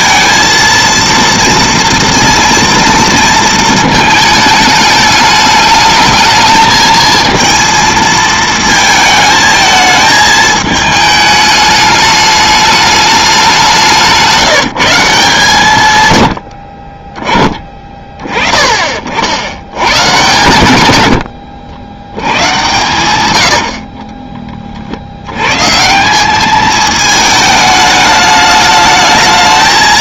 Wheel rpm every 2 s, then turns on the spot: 230, 230, 210, 220, 220, 220, 210, 180, 50, 40, 110, 120, 30, 210, 210.
none